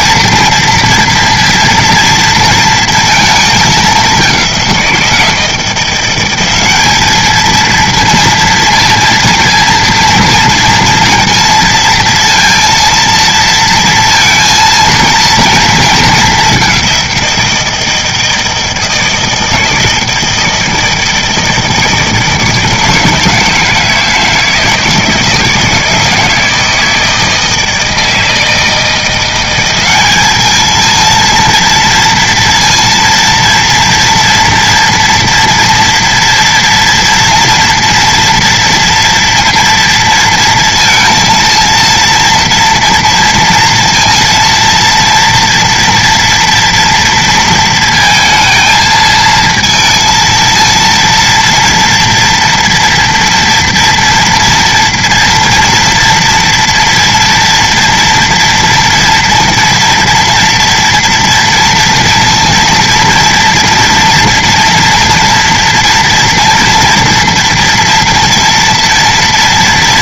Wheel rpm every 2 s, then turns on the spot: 230, 230, 190, 190, 230, 230, 230, 230, 200, 160, 160, 160, 160, 160, 160, 220, 230, 230, 230, 230, 230, 230, 230, 240, 230, 230, 240, 230, 240, 230, 240, 230, 240, 230, 230.
none